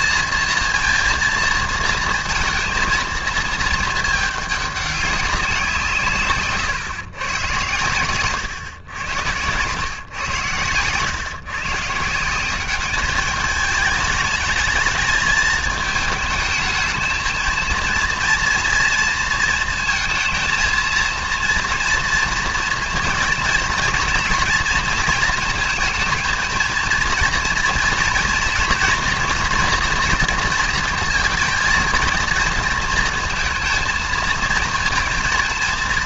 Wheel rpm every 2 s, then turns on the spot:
230, 230, 200, 140, 100, 110, 200, 220, 220, 230, 230, 230, 230, 220, 240, 230, 230, 230.
none